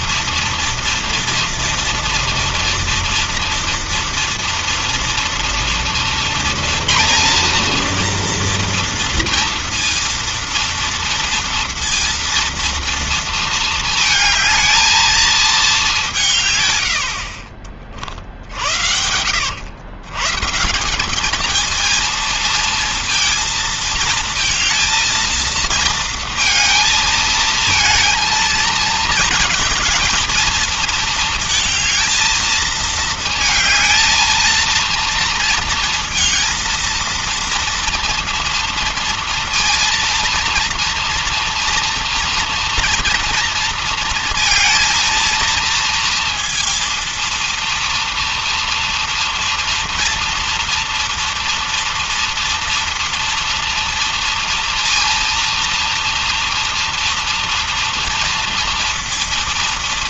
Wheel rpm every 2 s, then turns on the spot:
230, 230, 230, 230, 230, 230, 230, 220, 150, 60, 150, 230, 230, 220, 220, 220, 230, 230, 230, 230, 230, 230, 230, 230, 230, 230, 230, 230, 230, 230.
none